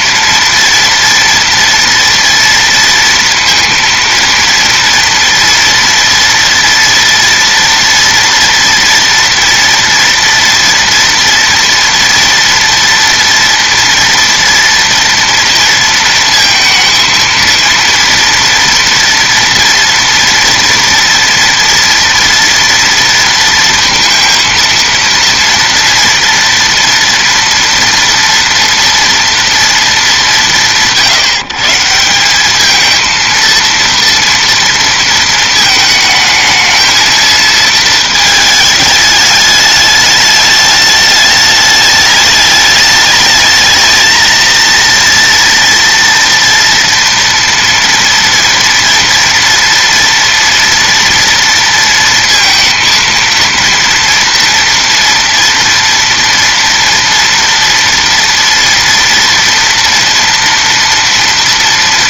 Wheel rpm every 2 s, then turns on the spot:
230, 230, 230, 230, 230, 230, 230, 230, 230, 230, 230, 230, 230, 230, 230, 180, 200, 230, 220, 220, 210, 210, 220, 230, 230, 240, 230, 230, 230, 230, 230.
none